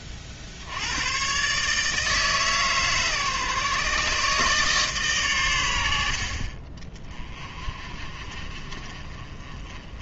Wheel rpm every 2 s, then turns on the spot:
70, 150, 150, 40, 30.
none